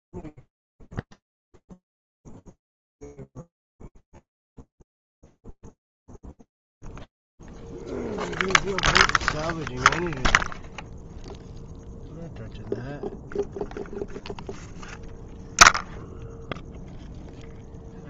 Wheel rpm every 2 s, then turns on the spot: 0, 0, 0, 0, 0, 0, 0, 0, 0.
none